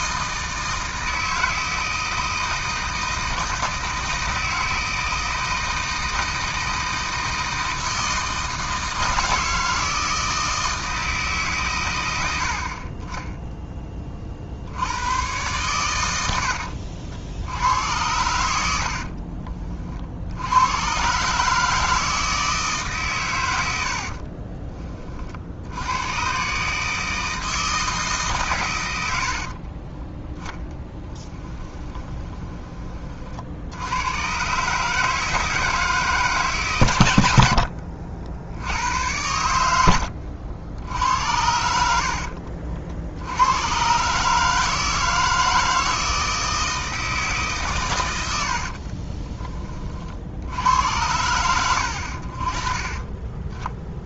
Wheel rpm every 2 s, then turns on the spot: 160, 160, 160, 160, 160, 160, 60, 70, 70, 70, 100, 150, 30, 140, 120, 10, 20, 130, 140, 80, 80, 60, 150, 160, 60, 80, 30.
18-20 24-26 30-32 48-50